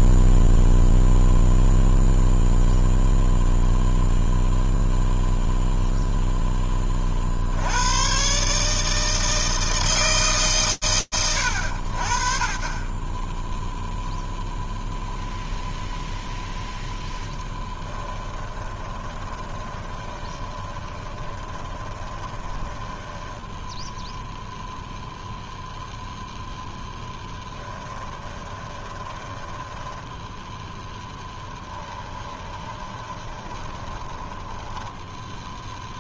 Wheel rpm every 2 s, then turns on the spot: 0, 0, 0, 10, 140, 100, 10, 0, 10, 20, 20, 10, 0, 10, 10, 0, 20, 10.
18-24 26-30 32-34